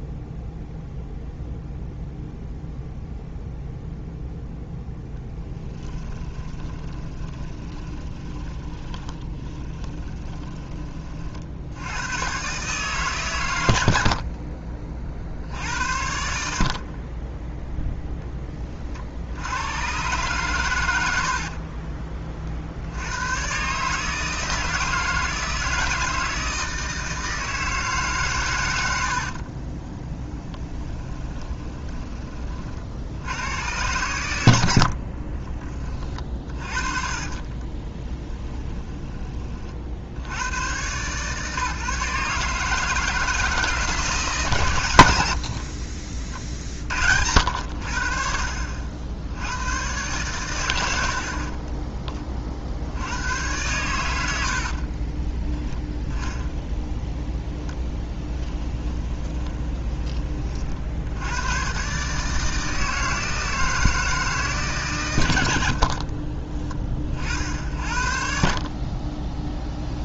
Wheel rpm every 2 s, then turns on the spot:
0, 0, 0, 20, 20, 20, 140, 40, 30, 40, 90, 70, 160, 160, 90, 10, 60, 60, 30, 20, 130, 160, 130, 60, 60, 90, 70, 40, 0, 20, 60, 160, 140, 30, 50.
6-10 30-32 34-40 54-56 58-60